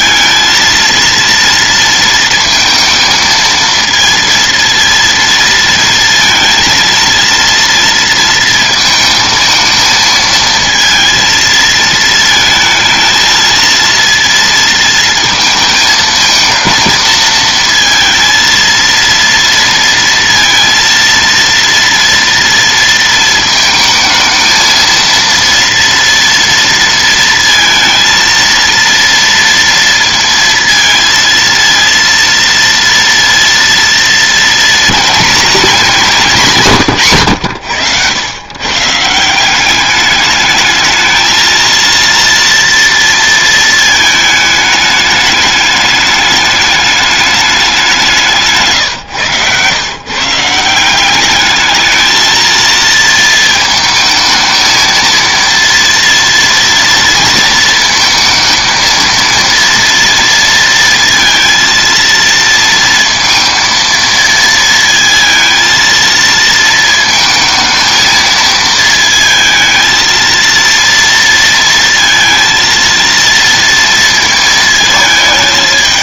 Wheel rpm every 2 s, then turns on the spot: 230, 230, 230, 230, 230, 230, 220, 220, 220, 230, 230, 230, 220, 230, 230, 230, 230, 230, 170, 140, 210, 230, 210, 210, 140, 160, 230, 220, 230, 220, 230, 230, 230, 220, 220, 230, 230, 220.
48-50